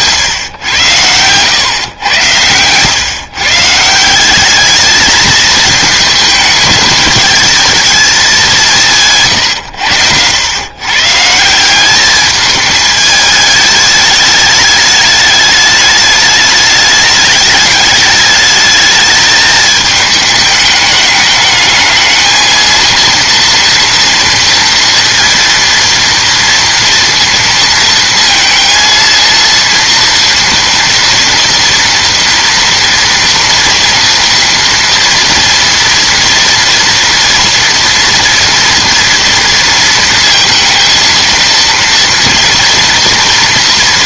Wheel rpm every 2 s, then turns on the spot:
110, 120, 210, 220, 170, 130, 210, 210, 210, 210, 210, 230, 230, 230, 230, 230, 230, 230, 230, 230, 230, 230.
none